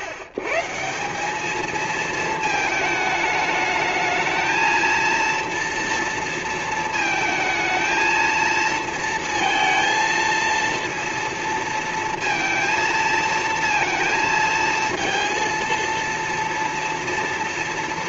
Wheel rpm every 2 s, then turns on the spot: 130, 220, 220, 230, 230, 230, 230, 230, 230.
none